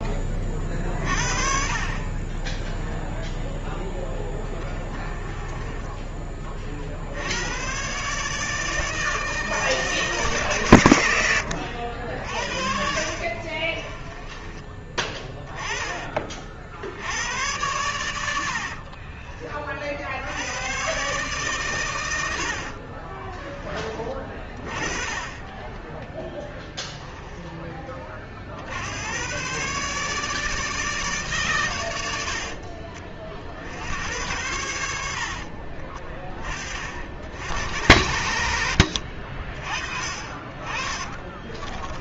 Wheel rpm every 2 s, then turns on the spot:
40, 10, 10, 60, 160, 110, 50, 20, 80, 50, 110, 30, 30, 10, 100, 150, 60, 70, 50, 50, 30.
4-6 12-14 18-20 22-24 40-42